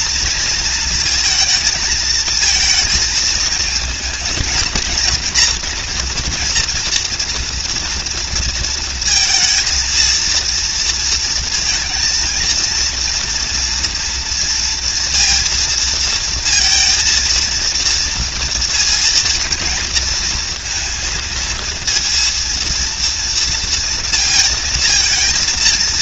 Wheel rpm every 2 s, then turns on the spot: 230, 220, 230, 230, 230, 230, 230, 230, 230, 230, 230, 230, 230.
none